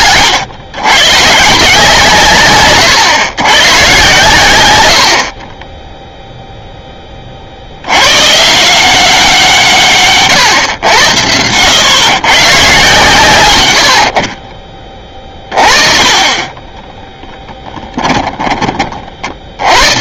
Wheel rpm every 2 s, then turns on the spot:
110, 130, 110, 0, 150, 130, 140, 30, 20, 20.
none